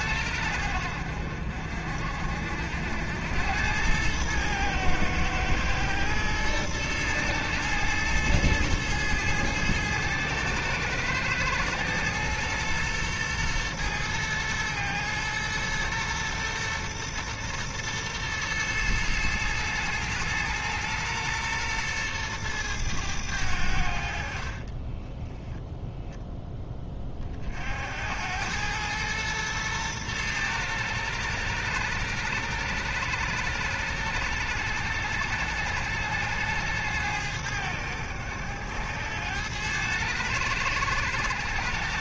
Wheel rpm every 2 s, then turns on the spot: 70, 70, 110, 110, 110, 110, 110, 110, 120, 110, 110, 110, 30, 20, 110, 110, 100, 100, 100, 90, 90.
24-26